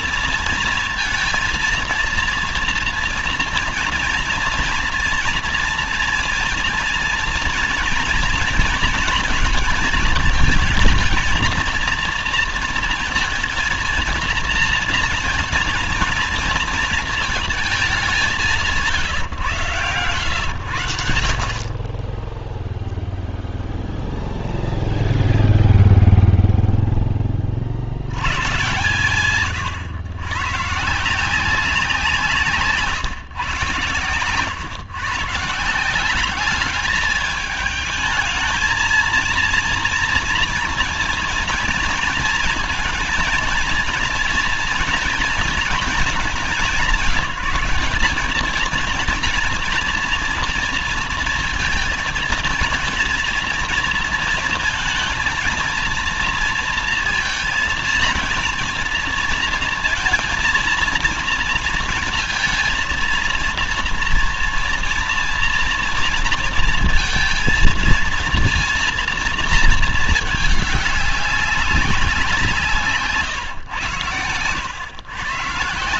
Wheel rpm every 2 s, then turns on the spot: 230, 230, 230, 230, 230, 220, 230, 230, 230, 170, 100, 0, 0, 0, 120, 130, 150, 120, 200, 220, 230, 230, 230, 200, 210, 230, 220, 230, 230, 230, 230, 230, 230, 230, 230, 210, 170, 110.
none